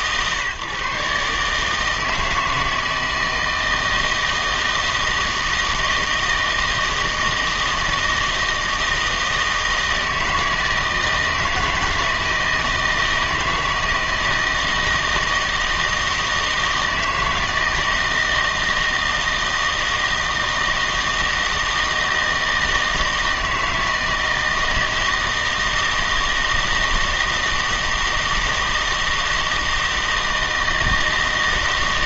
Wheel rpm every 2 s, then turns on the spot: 140, 160, 160, 160, 160, 160, 160, 160, 160, 160, 160, 160, 160, 160, 160, 160.
none